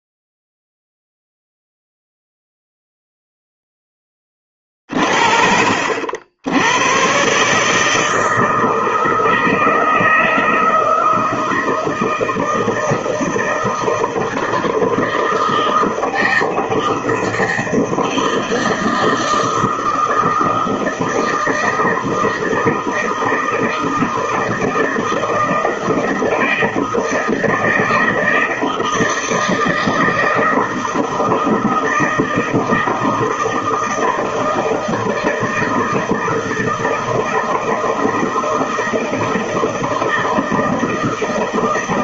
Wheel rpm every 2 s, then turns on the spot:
0, 0, 30, 90, 160, 160, 160, 160, 160, 160, 160, 160, 160, 160, 160, 160, 160, 160, 160, 160, 160.
none